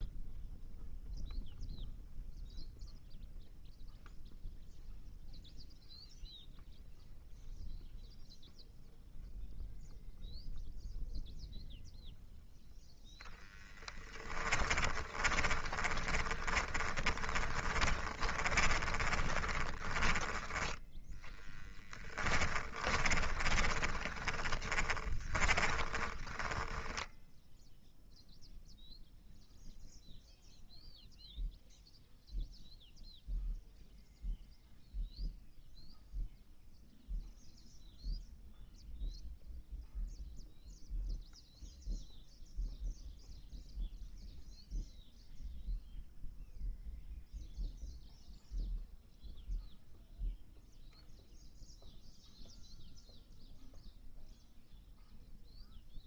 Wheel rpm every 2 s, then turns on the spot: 0, 0, 0, 0, 0, 0, 0, 20, 20, 20, 0, 20, 20, 10, 0, 0, 0, 0, 0, 0, 0, 0, 0, 0, 0, 0, 0, 0.
14-20 22-28